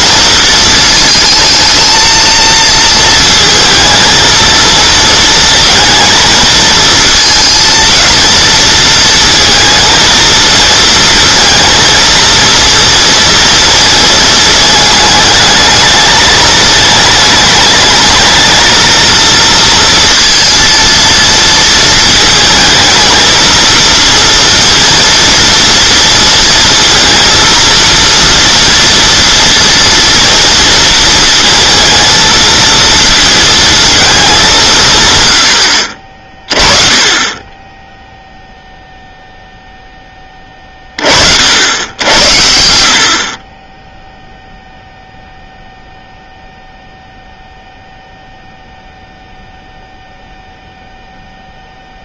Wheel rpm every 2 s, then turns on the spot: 230, 230, 230, 220, 230, 230, 230, 220, 210, 220, 230, 220, 230, 230, 230, 230, 230, 190, 30, 0, 30, 60, 0, 0, 0, 0.
none